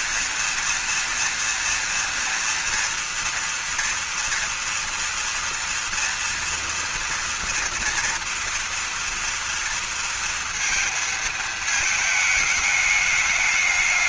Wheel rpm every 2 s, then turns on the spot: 230, 230, 230, 230, 230, 230, 210.
none